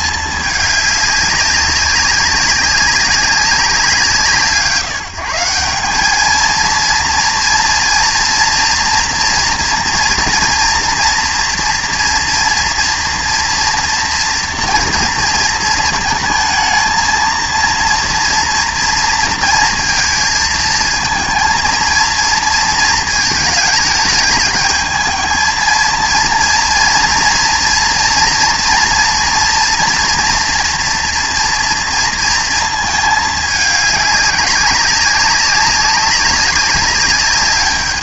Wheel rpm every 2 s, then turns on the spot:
210, 200, 140, 230, 230, 230, 230, 230, 220, 230, 230, 230, 220, 230, 230, 230, 220, 200, 200.
none